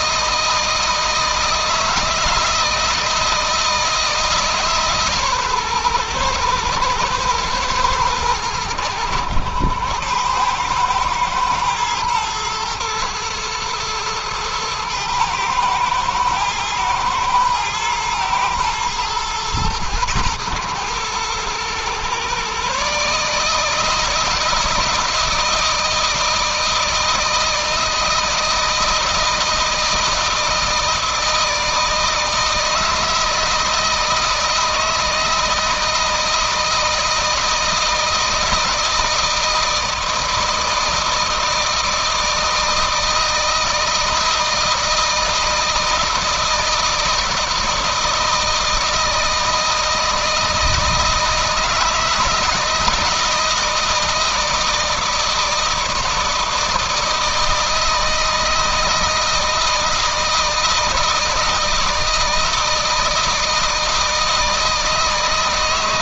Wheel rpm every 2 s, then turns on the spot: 160, 160, 140, 110, 100, 110, 120, 110, 110, 120, 110, 140, 160, 160, 160, 160, 160, 160, 160, 160, 160, 160, 160, 160, 160, 160, 160, 160, 160, 160, 160, 160, 160.
none